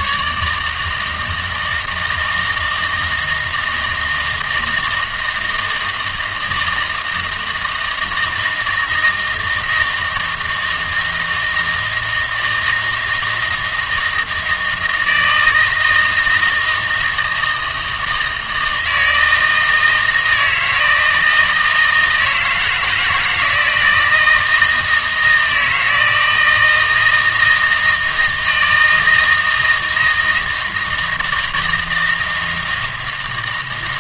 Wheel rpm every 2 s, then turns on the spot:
150, 160, 160, 160, 160, 160, 160, 160, 160, 160, 160, 160, 160, 160, 160, 160, 160.
none